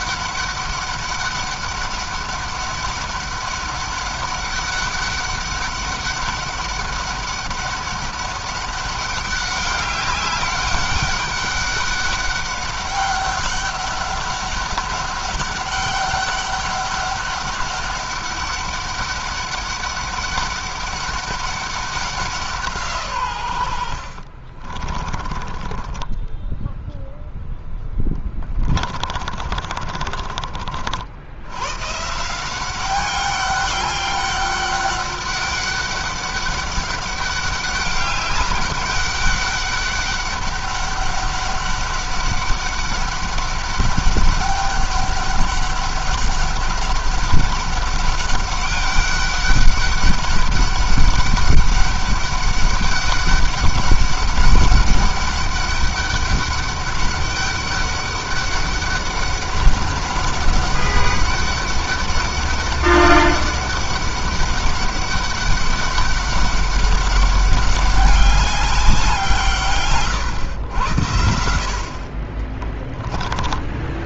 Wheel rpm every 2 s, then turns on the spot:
200, 200, 200, 200, 200, 200, 200, 200, 200, 200, 200, 160, 40, 0, 30, 50, 190, 200, 200, 200, 200, 200, 200, 200, 200, 190, 200, 200, 200, 200, 200, 200, 200, 200, 190, 100, 20.
24-26 28-30 72-74